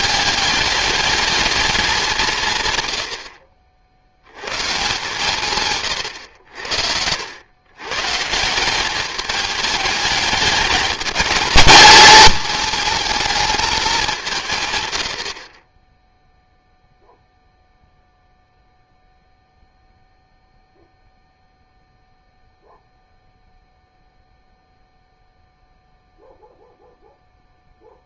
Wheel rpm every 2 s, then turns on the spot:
210, 120, 140, 80, 190, 210, 220, 110, 0, 0, 0, 0, 0, 0.
none